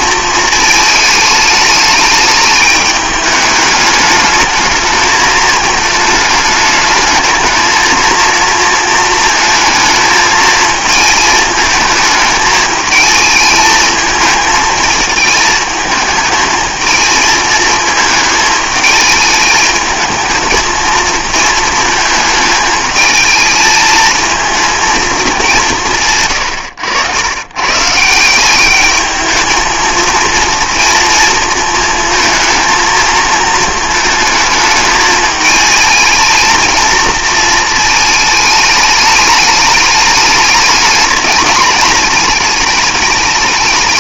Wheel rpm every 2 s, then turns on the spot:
220, 210, 210, 220, 230, 220, 220, 220, 220, 220, 220, 220, 230, 110, 200, 230, 230, 220, 220, 210, 210, 210.
none